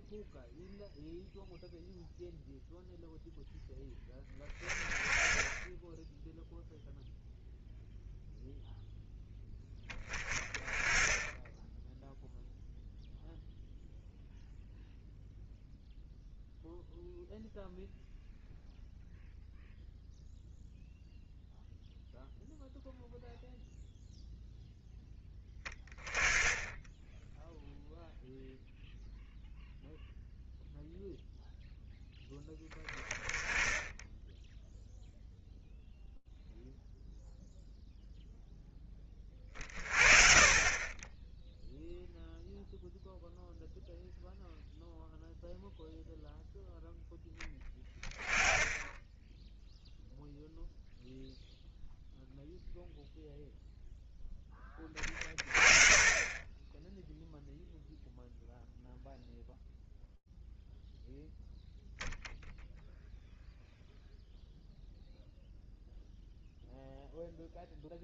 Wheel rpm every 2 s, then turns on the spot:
0, 0, 20, 0, 0, 20, 0, 0, 0, 0, 0, 0, 10, 10, 0, 0, 10, 0, 0, 10, 20, 0, 0, 0, 10, 0, 0, 20, 10, 0, 0, 0, 0, 0.
none